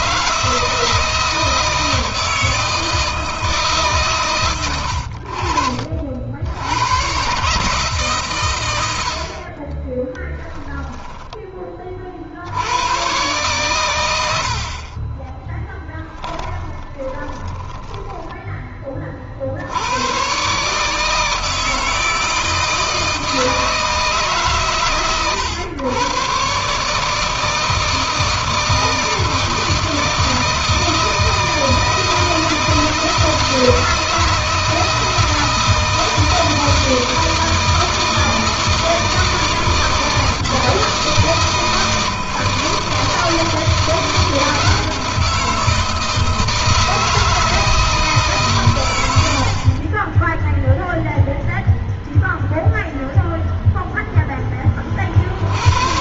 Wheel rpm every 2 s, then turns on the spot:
160, 160, 90, 100, 90, 10, 100, 40, 20, 30, 150, 160, 130, 150, 160, 160, 160, 160, 160, 160, 160, 160, 170, 160, 100, 0, 0, 30.
10-12 16-18